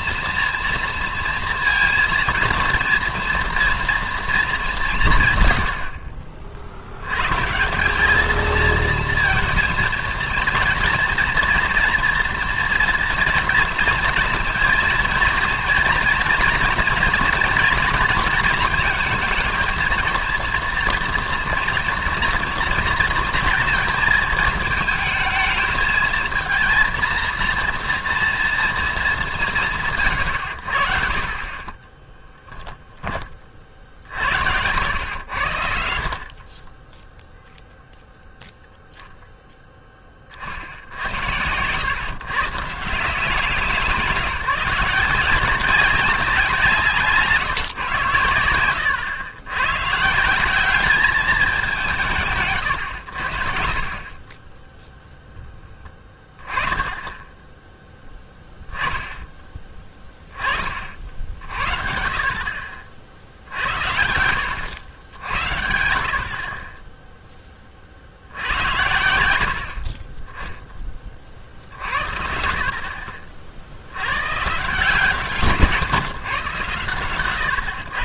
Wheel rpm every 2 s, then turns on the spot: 230, 230, 210, 50, 220, 230, 240, 230, 230, 230, 230, 230, 220, 230, 230, 70, 10, 80, 40, 0, 50, 150, 170, 170, 90, 190, 130, 20, 10, 10, 30, 50, 90, 30, 80, 10, 50, 160, 130.
none